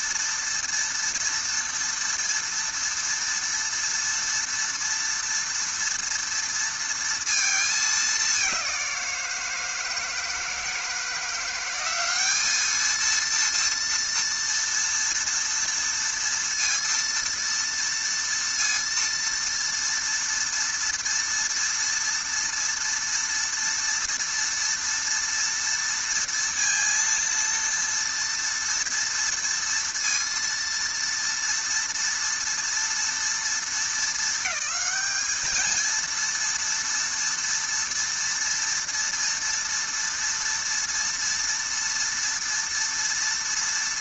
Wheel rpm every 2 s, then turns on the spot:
230, 230, 230, 230, 190, 160, 210, 230, 230, 230, 230, 230, 230, 230, 230, 230, 230, 220, 230, 230, 230, 230.
none